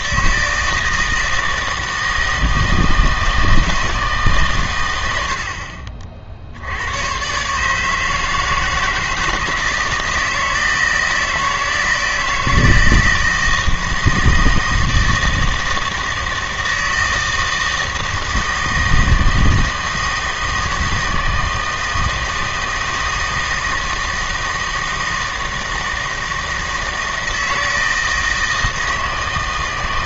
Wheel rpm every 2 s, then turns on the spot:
160, 160, 120, 90, 160, 170, 170, 160, 160, 160, 160, 160, 160, 160, 160.
none